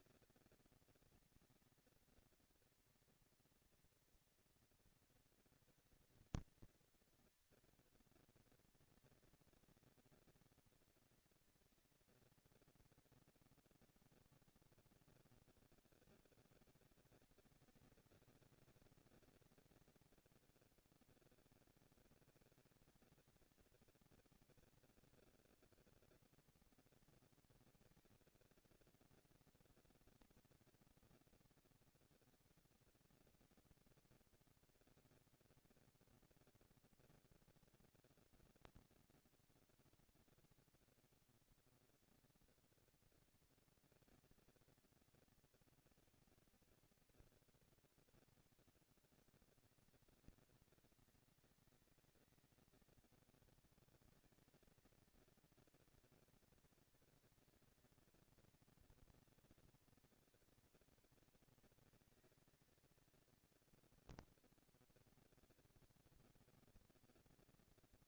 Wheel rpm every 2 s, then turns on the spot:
230, 230, 230, 220, 230, 230, 230, 180, 200, 190, 200, 220, 230, 230, 230, 230, 230, 230, 230, 230, 230, 240, 220, 230, 230, 190, 190, 210, 230, 230, 230, 230, 240, 230.
none